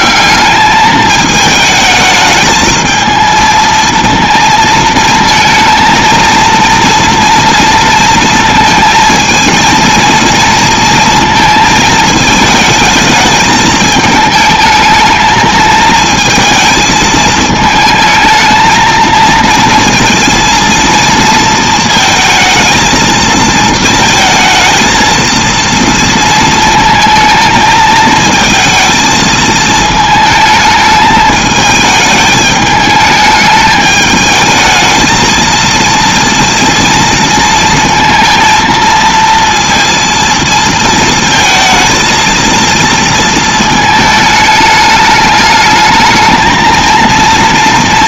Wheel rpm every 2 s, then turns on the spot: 210, 220, 230, 230, 220, 230, 220, 220, 220, 220, 230, 220, 230, 230, 220, 220, 210, 220, 230, 230, 230, 230, 210, 220.
none